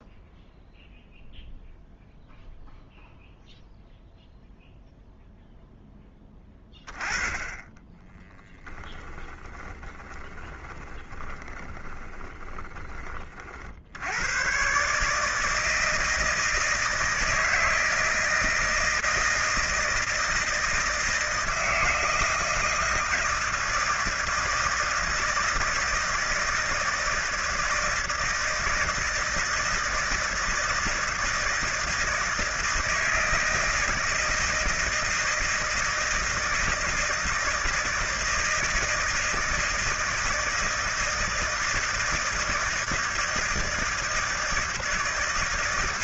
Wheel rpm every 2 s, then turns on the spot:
0, 0, 0, 10, 10, 20, 30, 130, 160, 160, 160, 160, 160, 160, 160, 160, 160, 160, 160, 160, 160, 160, 160.
8-12